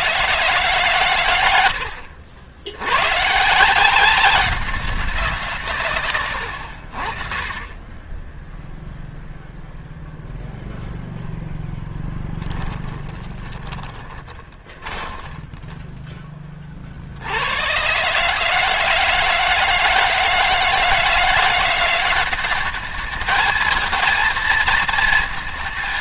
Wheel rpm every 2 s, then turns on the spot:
130, 90, 190, 80, 0, 0, 10, 10, 30, 150, 160, 200, 230.
12-16